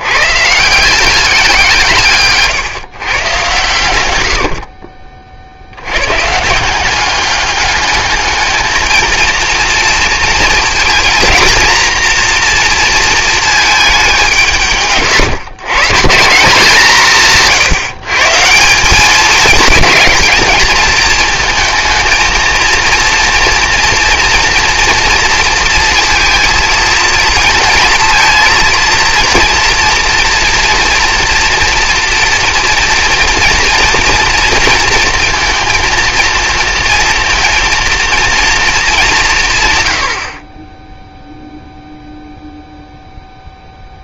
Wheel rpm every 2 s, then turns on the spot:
160, 150, 50, 180, 220, 220, 230, 140, 170, 200, 220, 230, 240, 230, 230, 230, 230, 230, 230, 210, 10, 0.
none